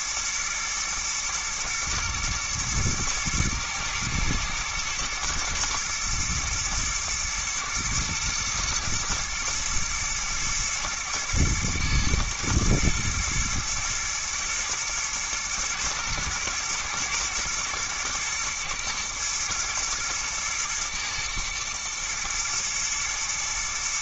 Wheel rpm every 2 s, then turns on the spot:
120, 110, 110, 120, 120, 120, 120, 120, 120, 110, 110, 110.
none